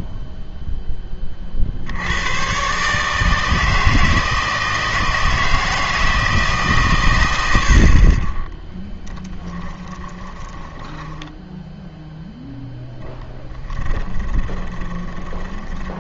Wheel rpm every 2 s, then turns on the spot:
10, 140, 160, 150, 10, 10, 0, 20.
10-12 14-16